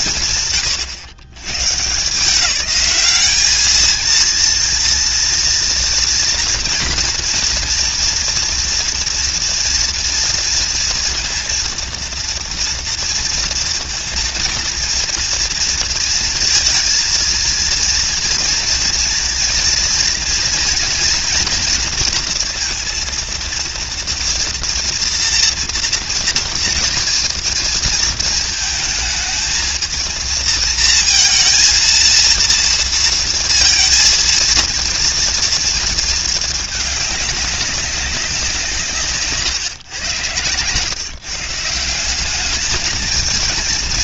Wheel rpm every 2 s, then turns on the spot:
110, 210, 230, 240, 230, 230, 230, 230, 230, 240, 230, 230, 230, 230, 220, 230, 230, 230, 200, 130, 150, 220.
none